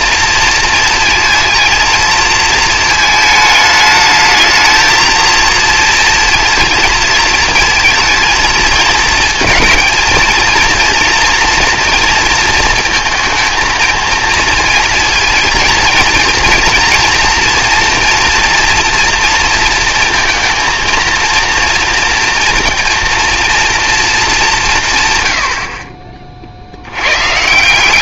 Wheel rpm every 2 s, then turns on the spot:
230, 220, 220, 230, 220, 230, 230, 230, 230, 230, 230, 230, 160, 70.
none